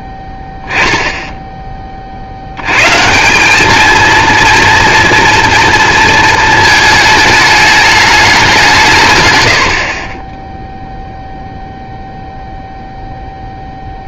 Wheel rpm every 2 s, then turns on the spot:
0, 90, 230, 220, 180, 0, 0.
none